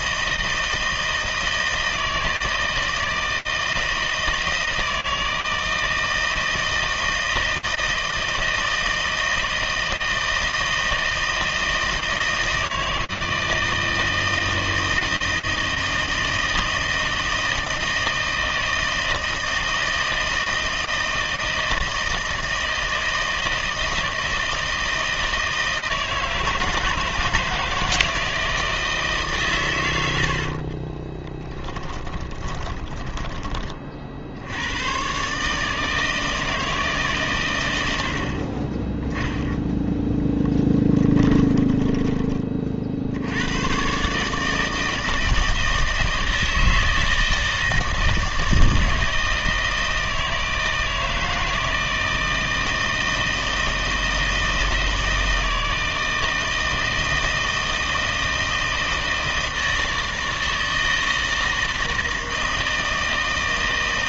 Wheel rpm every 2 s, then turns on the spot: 160, 160, 160, 160, 160, 160, 160, 160, 160, 160, 160, 160, 160, 160, 160, 50, 20, 100, 160, 20, 10, 40, 160, 160, 160, 160, 160, 160, 160, 160, 160, 160.
30-34 40-42